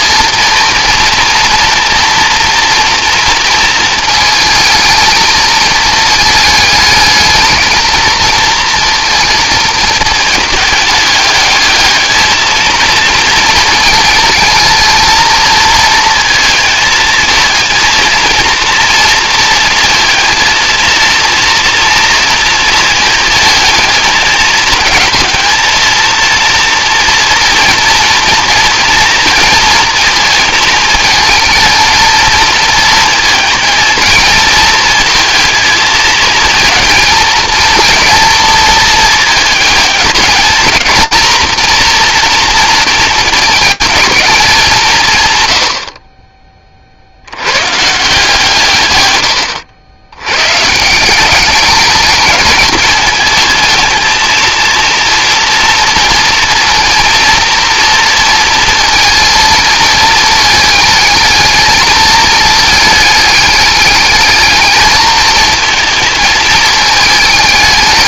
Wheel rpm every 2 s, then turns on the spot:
230, 230, 220, 220, 230, 210, 220, 220, 230, 230, 230, 230, 220, 230, 230, 220, 230, 230, 230, 220, 230, 230, 160, 50, 130, 170, 220, 230, 230, 230, 220, 220, 220, 210.
none